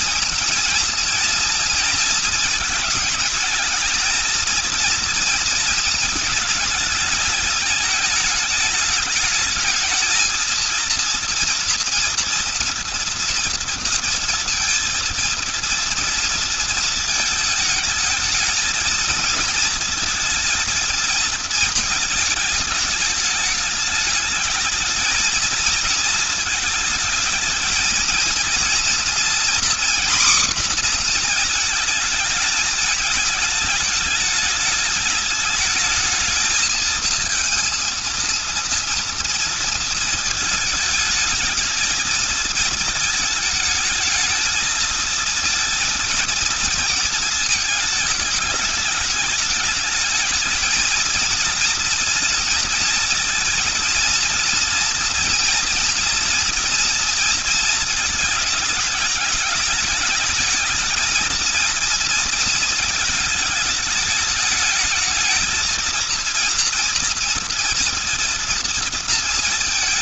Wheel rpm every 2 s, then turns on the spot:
230, 220, 220, 220, 210, 220, 230, 230, 230, 220, 230, 220, 220, 220, 230, 250, 220, 210, 220, 230, 220, 220, 220, 230, 210, 220, 230, 230, 230, 220, 220, 230, 210, 230, 230.
none